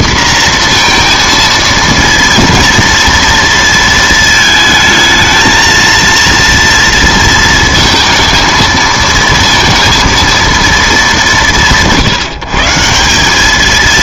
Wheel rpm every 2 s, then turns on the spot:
240, 230, 220, 230, 230, 230, 160.
none